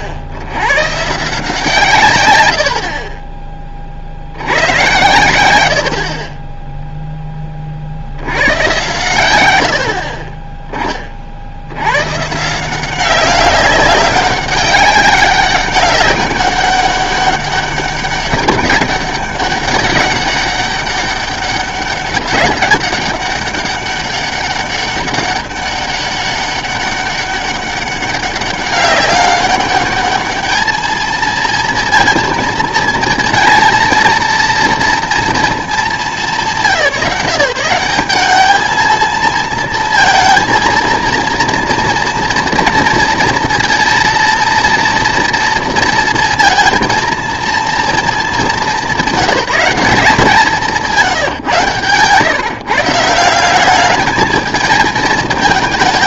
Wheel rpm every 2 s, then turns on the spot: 80, 80, 90, 20, 110, 20, 170, 200, 200, 200, 200, 200, 200, 200, 200, 210, 230, 230, 180, 210, 230, 230, 230, 230, 210, 170, 150, 220.
2-4 6-8